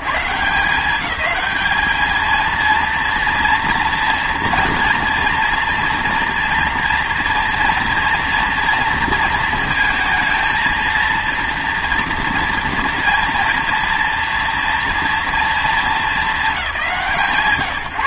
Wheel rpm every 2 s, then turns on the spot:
190, 230, 230, 230, 230, 230, 230, 230, 190.
none